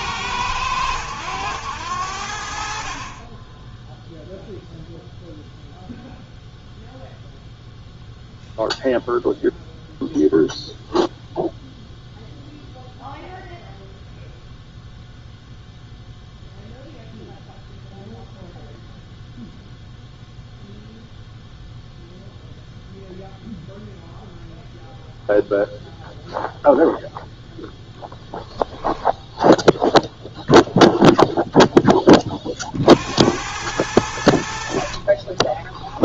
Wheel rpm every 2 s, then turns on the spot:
100, 70, 0, 0, 0, 0, 0, 0, 0, 0, 0, 0, 0, 0, 0, 0, 30, 80.
none